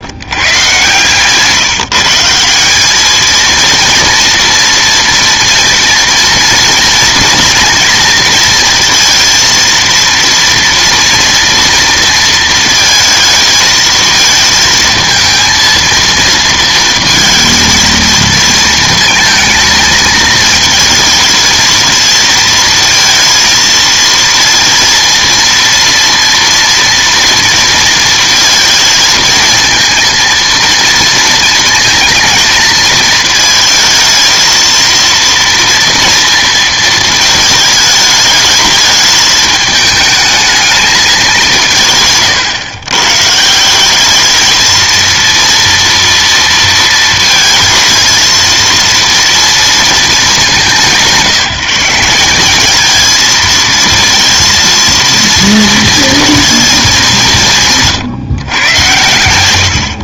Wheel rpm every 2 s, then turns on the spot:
130, 190, 230, 230, 230, 240, 230, 220, 230, 230, 220, 230, 230, 240, 230, 230, 220, 220, 230, 210, 220, 130, 220, 230, 230, 200, 200, 230, 220, 130.
0-2